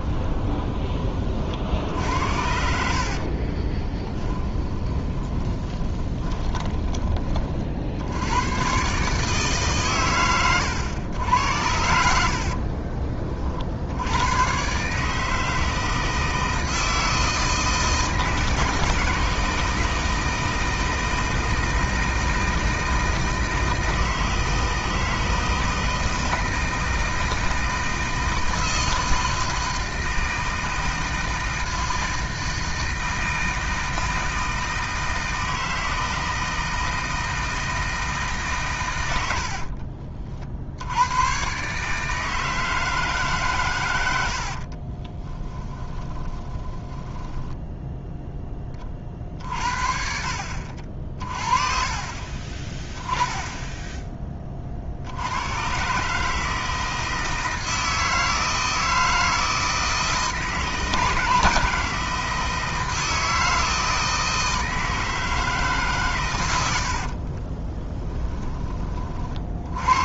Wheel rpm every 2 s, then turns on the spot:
30, 70, 20, 20, 130, 100, 40, 140, 160, 160, 160, 160, 160, 160, 160, 160, 160, 160, 160, 120, 70, 160, 40, 20, 30, 50, 20, 50, 160, 160, 160, 160, 160, 80, 30.
2-6 12-14 44-48 66-68